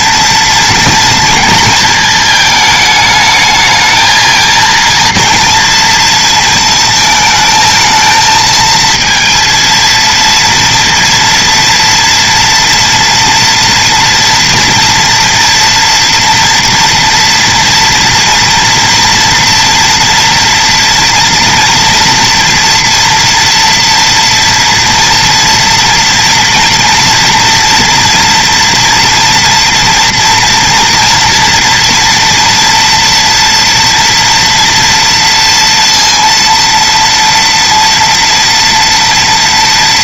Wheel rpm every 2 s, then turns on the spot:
230, 220, 230, 220, 220, 230, 230, 230, 230, 230, 240, 230, 230, 230, 230, 230, 230, 230, 230, 230.
none